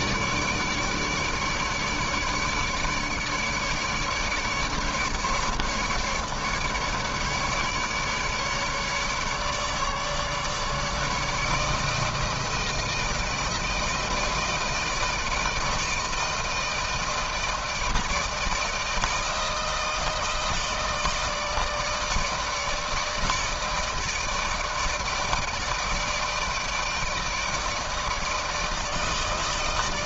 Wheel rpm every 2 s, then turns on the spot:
150, 150, 150, 150, 150, 150, 160, 160, 160, 160, 160, 160, 160, 160, 160.
none